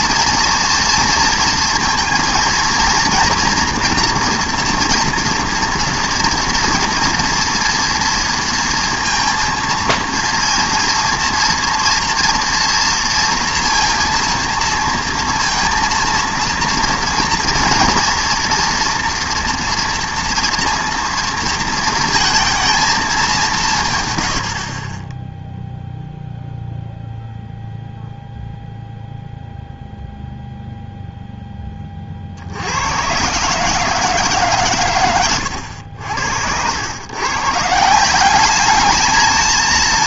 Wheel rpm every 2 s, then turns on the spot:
230, 230, 240, 230, 230, 230, 230, 230, 230, 230, 230, 230, 60, 0, 0, 0, 70, 130, 80, 210.
none